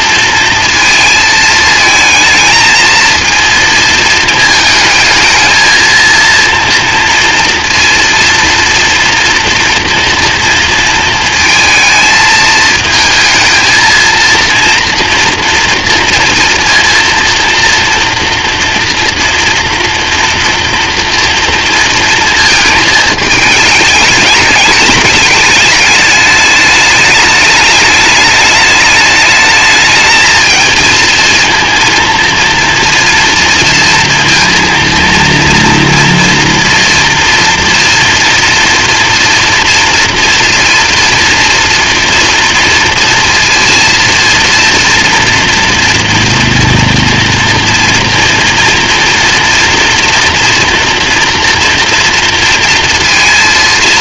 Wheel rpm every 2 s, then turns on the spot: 230, 230, 220, 230, 230, 230, 220, 240, 230, 230, 230, 220, 210, 210, 210, 230, 230, 230, 230, 230, 230, 230, 230, 230, 230, 230, 230.
none